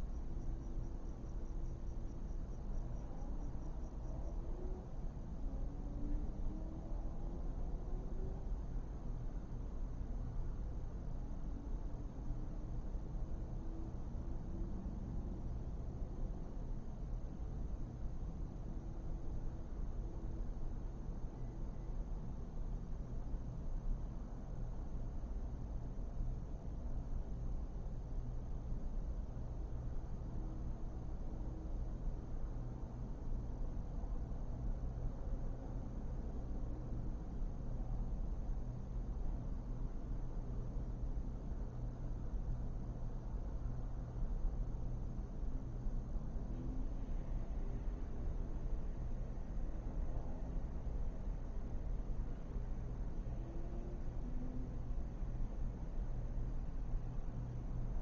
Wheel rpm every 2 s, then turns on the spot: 0, 0, 0, 0, 0, 0, 0, 0, 0, 0, 0, 0, 0, 0, 0, 0, 0, 0, 0, 0, 0, 0, 0, 0, 0, 0, 0, 0, 0.
none